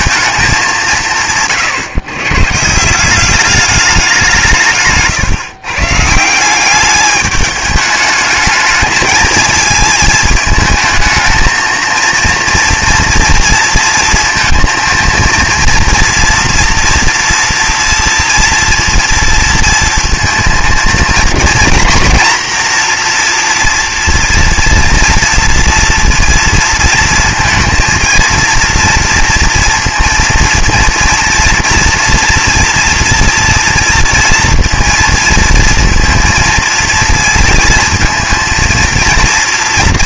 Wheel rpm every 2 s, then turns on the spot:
190, 160, 150, 200, 210, 220, 230, 230, 230, 230, 230, 240, 230, 230, 230, 230, 240, 230, 230, 230.
none